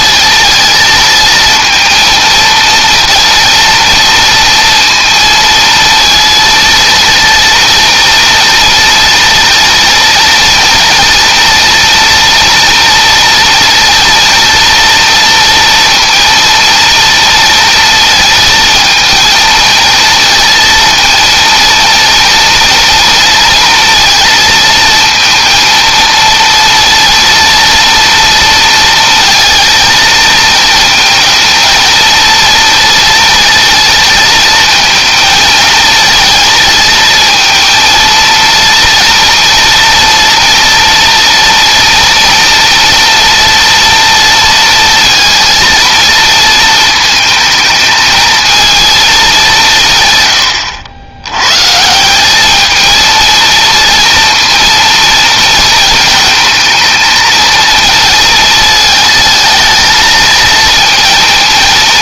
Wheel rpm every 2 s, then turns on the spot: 220, 230, 230, 230, 240, 230, 230, 230, 230, 220, 230, 230, 230, 230, 230, 230, 230, 220, 220, 230, 230, 230, 230, 220, 230, 100, 220, 230, 220, 220, 220.
none